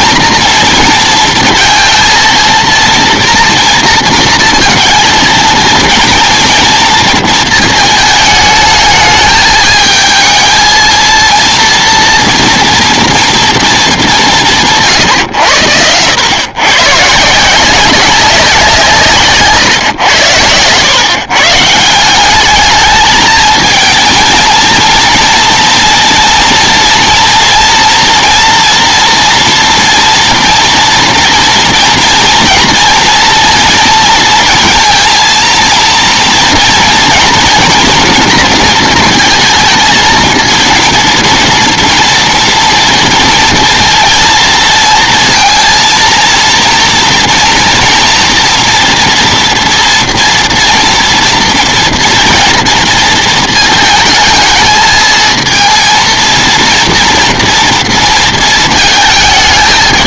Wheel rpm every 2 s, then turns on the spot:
230, 230, 230, 230, 220, 220, 230, 150, 130, 170, 110, 210, 230, 230, 230, 230, 230, 230, 230, 230, 230, 230, 230, 230, 230, 230, 230, 220, 230, 230.
none